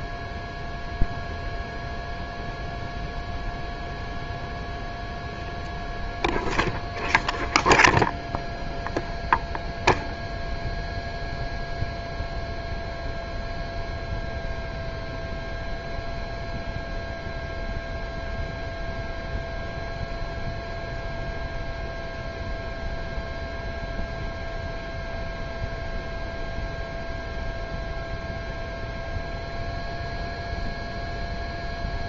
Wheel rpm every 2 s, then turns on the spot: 0, 0, 0, 0, 0, 0, 0, 0, 0, 0, 0, 0, 0, 0, 0, 0.
none